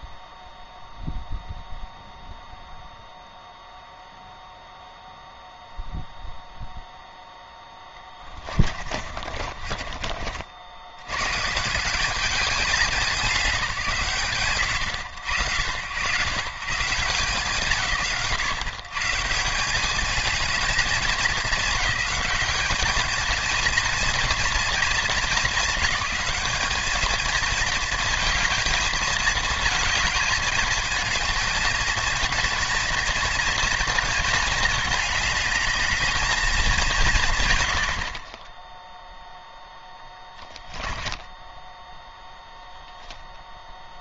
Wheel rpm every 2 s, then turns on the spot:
0, 0, 0, 0, 40, 90, 200, 90, 140, 140, 210, 220, 220, 210, 230, 220, 230, 210, 190, 0, 10, 0.
8-10 40-42